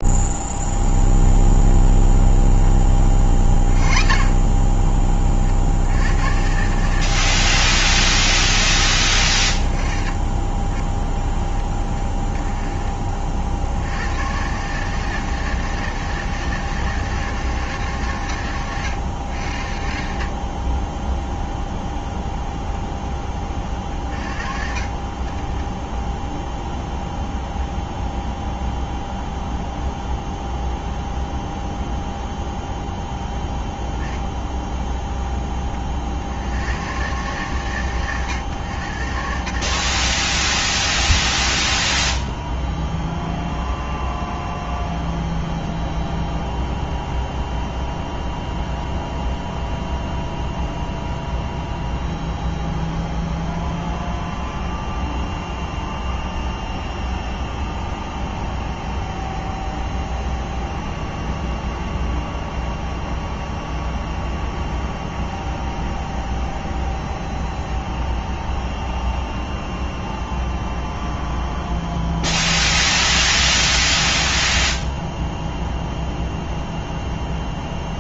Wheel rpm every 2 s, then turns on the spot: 0, 0, 20, 90, 40, 20, 20, 110, 160, 120, 40, 0, 30, 0, 0, 0, 0, 10, 50, 120, 40, 0, 0, 0, 0, 0, 0, 0, 0, 0, 0, 0, 0, 0, 0, 0, 0, 0, 0.
none